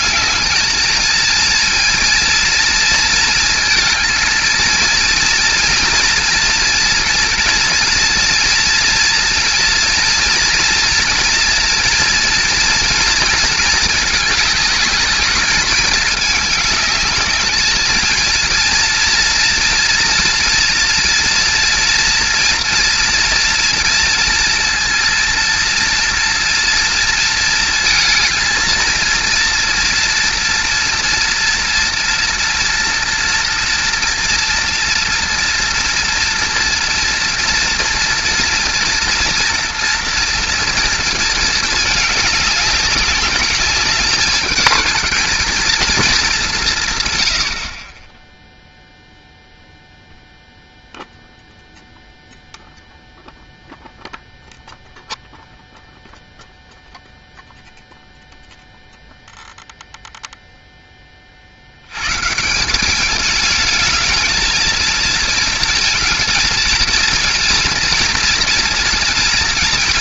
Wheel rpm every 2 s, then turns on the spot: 220, 230, 230, 230, 230, 230, 240, 210, 210, 230, 240, 230, 230, 230, 220, 230, 230, 240, 240, 230, 230, 200, 220, 170, 0, 0, 0, 0, 0, 0, 0, 180, 220, 230, 230.
none